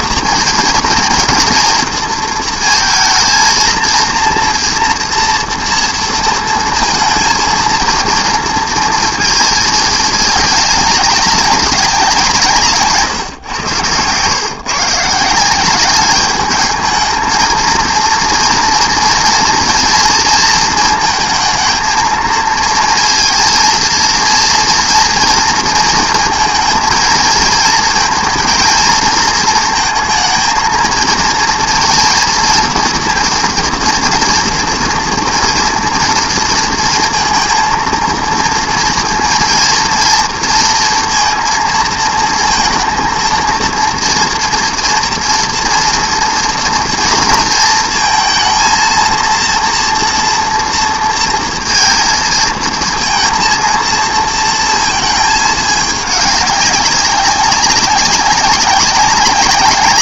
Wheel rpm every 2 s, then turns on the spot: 230, 230, 230, 230, 230, 200, 150, 140, 210, 230, 230, 230, 230, 230, 220, 230, 230, 230, 230, 230, 230, 230, 230, 230, 230, 230, 230, 230, 200, 200.
none